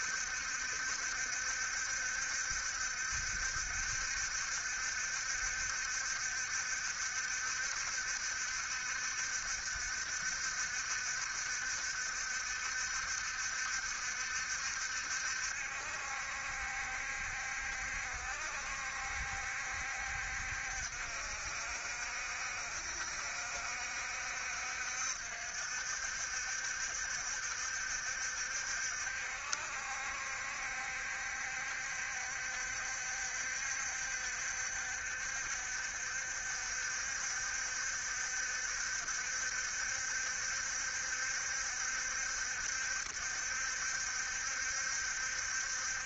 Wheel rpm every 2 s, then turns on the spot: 70, 70, 70, 70, 70, 60, 70, 70, 70, 60, 70, 70, 60, 60, 60, 70, 70, 70, 70, 70, 70, 70, 70.
none